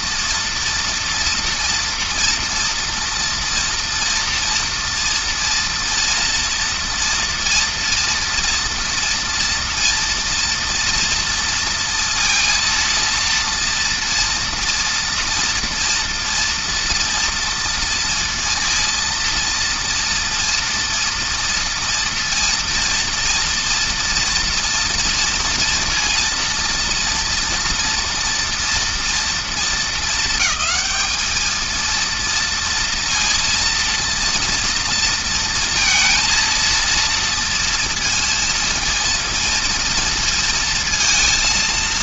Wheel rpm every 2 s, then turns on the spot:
230, 230, 230, 230, 230, 230, 230, 230, 230, 230, 230, 230, 230, 230, 240, 220, 230, 230, 230, 230, 230.
none